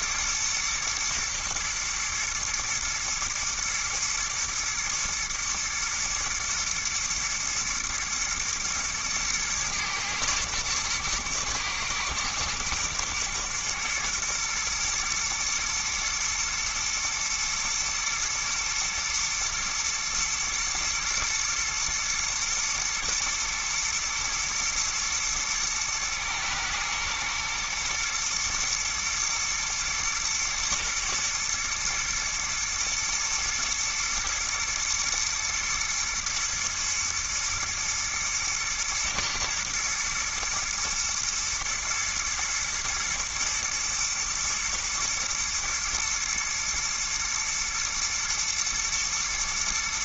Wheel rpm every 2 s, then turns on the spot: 110, 110, 110, 120, 120, 120, 110, 120, 110, 120, 110, 120, 110, 110, 110, 120, 120, 110, 110, 110, 120, 110, 110, 110, 120.
none